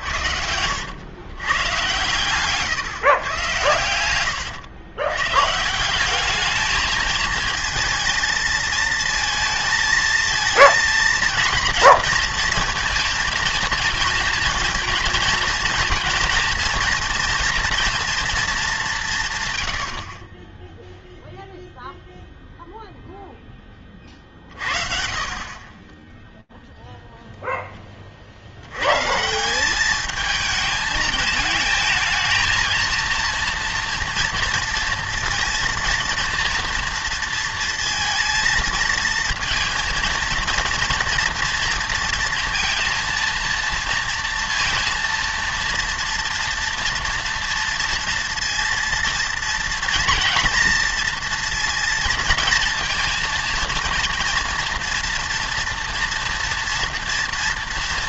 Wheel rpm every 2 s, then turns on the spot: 80, 140, 110, 220, 220, 230, 230, 220, 230, 210, 10, 0, 40, 0, 130, 220, 220, 230, 230, 230, 230, 230, 230, 230, 230, 230, 230, 230, 230.
none